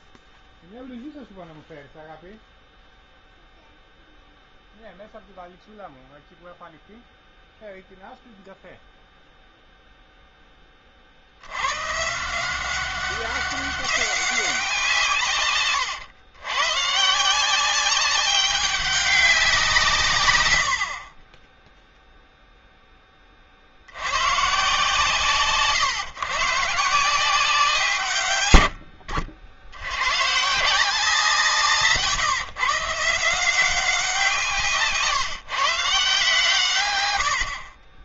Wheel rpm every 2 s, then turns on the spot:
0, 0, 0, 0, 0, 30, 190, 180, 130, 200, 80, 10, 140, 150, 80, 160, 140, 160, 130.
none